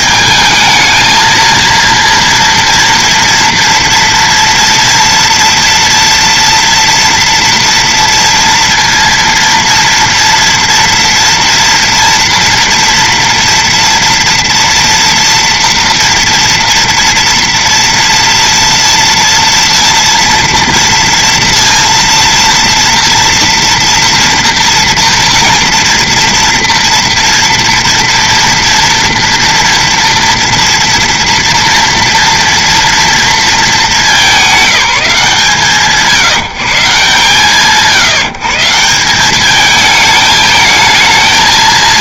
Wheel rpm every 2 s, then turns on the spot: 220, 230, 230, 230, 230, 240, 230, 230, 230, 230, 230, 240, 230, 230, 230, 230, 230, 180, 150, 170, 220.
none